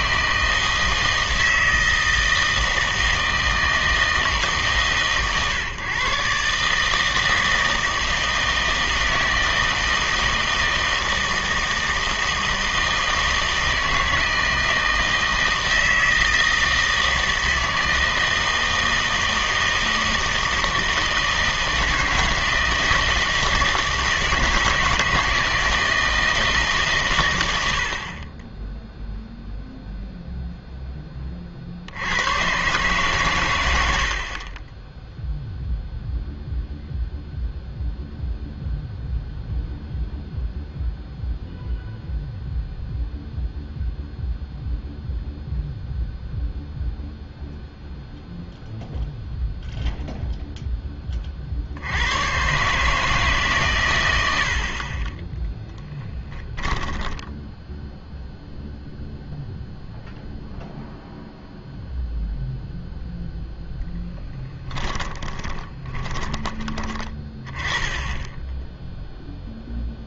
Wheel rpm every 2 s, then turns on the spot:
160, 160, 150, 140, 160, 160, 160, 160, 160, 160, 160, 160, 160, 150, 10, 0, 120, 30, 0, 0, 0, 0, 0, 0, 0, 0, 130, 50, 10, 0, 0, 0, 10, 20, 0.
54-58 64-66